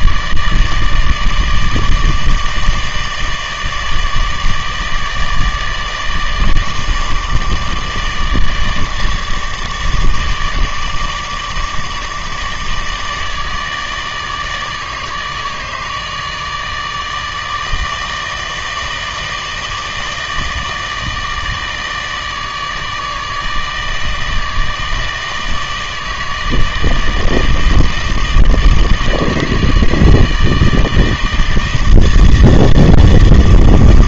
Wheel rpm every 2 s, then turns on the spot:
150, 150, 150, 150, 160, 160, 150, 150, 150, 160, 160, 150, 160, 160, 160, 160, 160.
none